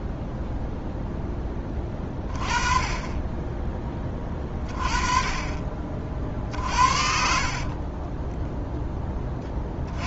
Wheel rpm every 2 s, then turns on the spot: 0, 30, 30, 50, 10.
none